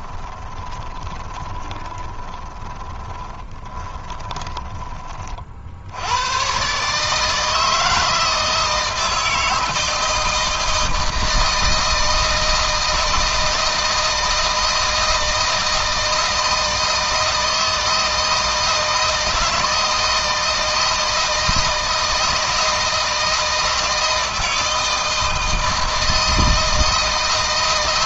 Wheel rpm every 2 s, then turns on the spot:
20, 10, 20, 130, 160, 160, 160, 160, 160, 160, 160, 160, 160, 160.
0-4